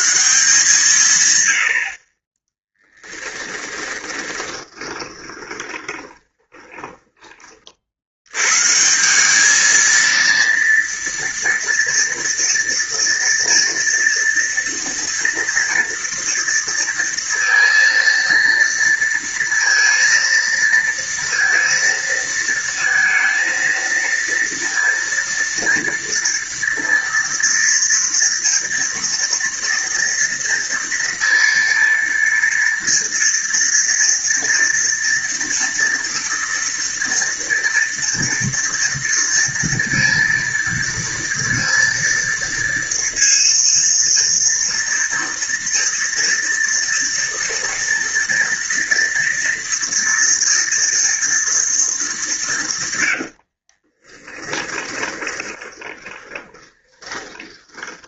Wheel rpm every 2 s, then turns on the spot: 160, 30, 20, 20, 100, 230, 230, 230, 230, 230, 230, 230, 230, 230, 230, 230, 230, 230, 230, 230, 230, 230, 230, 230, 230, 240, 210, 20, 20.
4-8 54-58